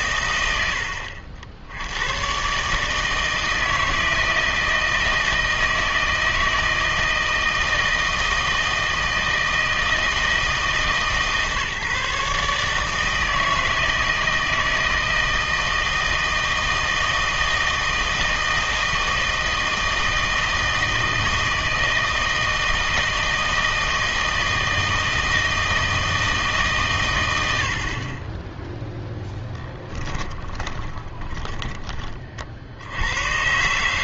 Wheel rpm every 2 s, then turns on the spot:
90, 150, 160, 160, 160, 160, 150, 160, 160, 160, 160, 160, 160, 140, 0, 20, 80.
30-32